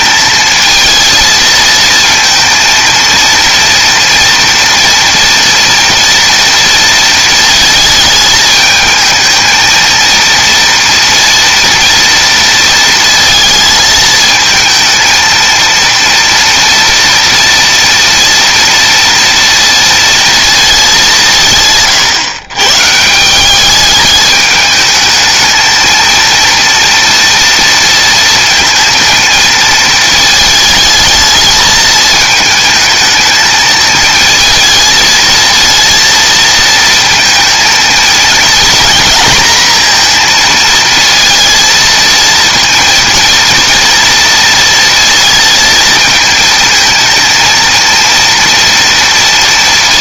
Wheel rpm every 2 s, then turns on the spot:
220, 230, 230, 230, 220, 230, 230, 220, 230, 230, 230, 130, 210, 230, 230, 220, 220, 220, 230, 220, 230, 230, 230, 230, 230.
none